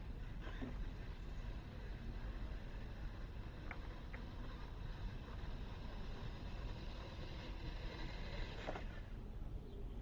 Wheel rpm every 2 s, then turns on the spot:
0, 0, 0, 0, 0.
none